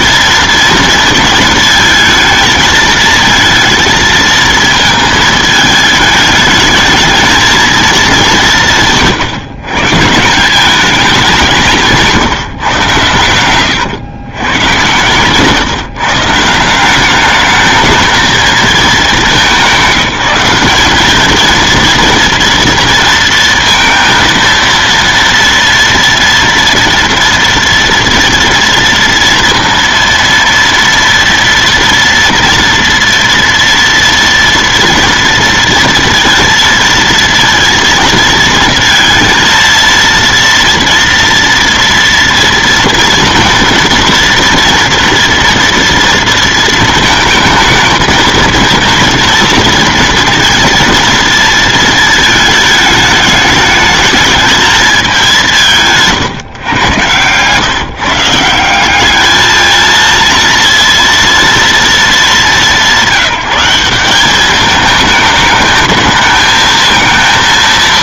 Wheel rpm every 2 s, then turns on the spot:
230, 220, 220, 210, 180, 180, 150, 110, 160, 210, 190, 230, 230, 240, 230, 230, 230, 230, 230, 220, 230, 230, 240, 230, 230, 230, 220, 220, 130, 170, 230, 180, 200, 220.
none